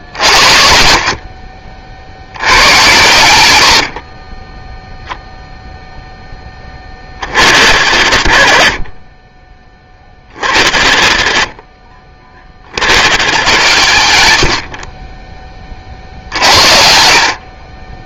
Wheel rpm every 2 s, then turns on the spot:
60, 90, 0, 10, 40, 40, 40, 70, 60.
none